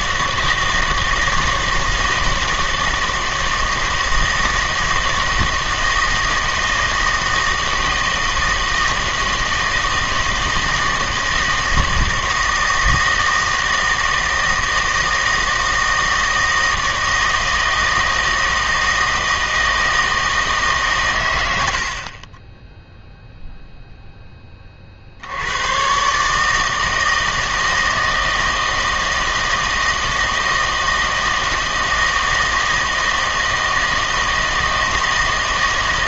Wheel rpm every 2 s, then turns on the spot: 160, 160, 160, 160, 160, 160, 160, 160, 160, 160, 150, 0, 30, 160, 160, 160, 160, 160.
none